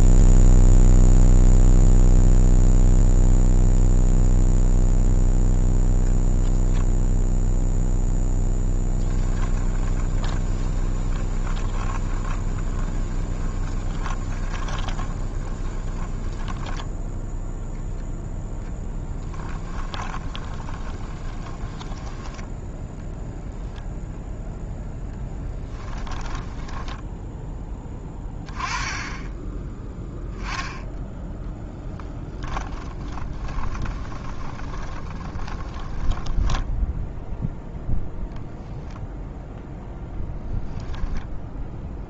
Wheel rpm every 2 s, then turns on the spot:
0, 0, 0, 0, 20, 20, 20, 20, 10, 0, 20, 10, 0, 10, 10, 10, 20, 20, 10, 10, 0.
8-18 20-22 26-28 32-38